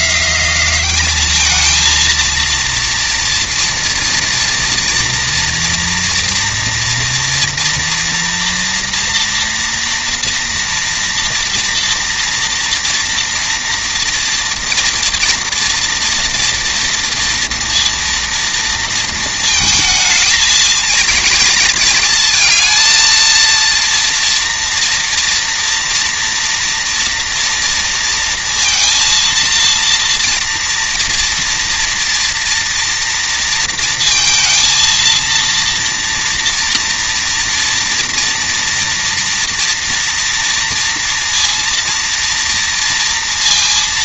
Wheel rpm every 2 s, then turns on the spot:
200, 230, 240, 230, 240, 230, 230, 230, 230, 230, 230, 230, 230, 230, 230, 240, 230, 230, 240, 230, 230, 230.
none